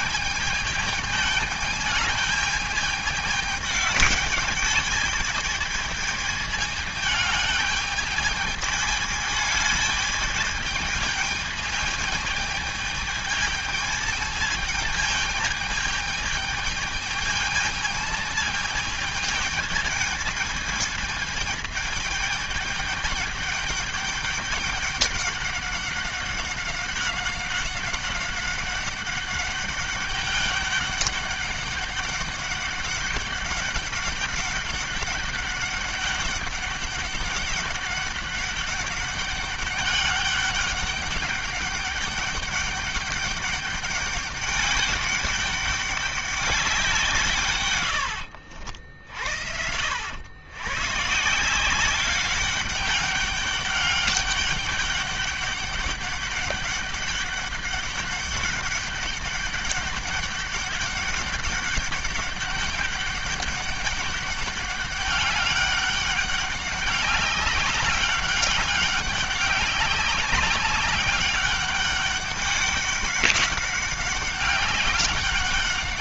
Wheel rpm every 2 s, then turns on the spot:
220, 220, 210, 220, 210, 220, 210, 210, 210, 220, 220, 210, 200, 190, 190, 200, 200, 200, 200, 200, 200, 200, 200, 190, 70, 110, 200, 200, 200, 200, 200, 200, 200, 200, 200, 200, 200, 200.
none